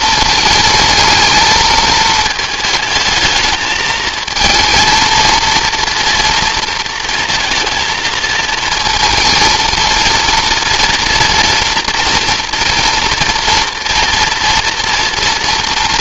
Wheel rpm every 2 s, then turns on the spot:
220, 220, 230, 230, 230, 230, 230, 230.
none